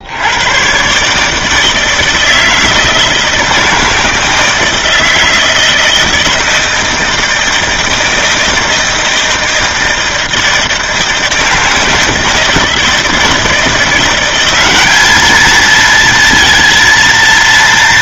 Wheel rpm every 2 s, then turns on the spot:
120, 160, 160, 160, 160, 160, 160, 200, 230.
none